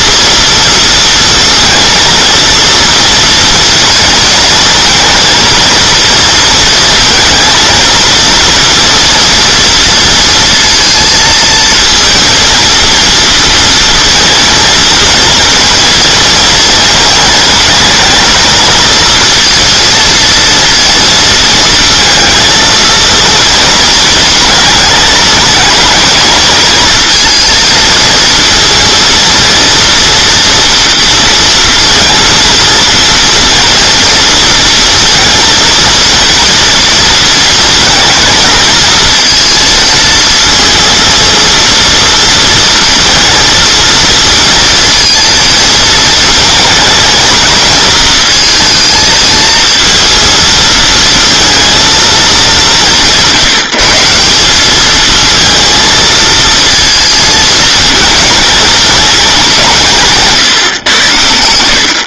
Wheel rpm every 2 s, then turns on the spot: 230, 230, 230, 230, 230, 230, 230, 230, 230, 230, 230, 230, 220, 220, 230, 230, 230, 230, 230, 230, 230, 230, 230, 220, 230, 230, 200, 190, 230, 210, 130.
none